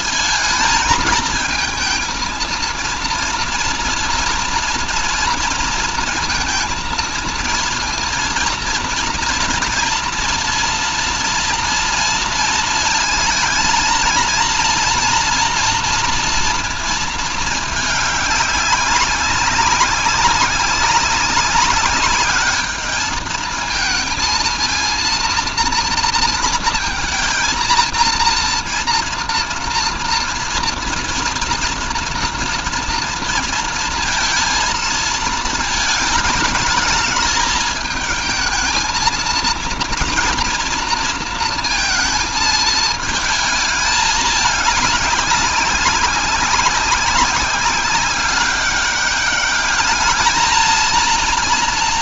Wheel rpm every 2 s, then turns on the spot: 220, 230, 240, 230, 230, 230, 230, 230, 230, 200, 190, 210, 230, 230, 230, 230, 230, 230, 210, 220, 230, 220, 200, 190, 200, 220.
none